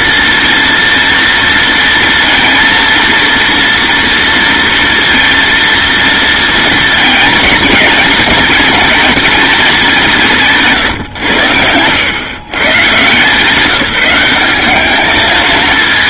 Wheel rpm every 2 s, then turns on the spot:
230, 230, 230, 220, 220, 150, 140, 210.
none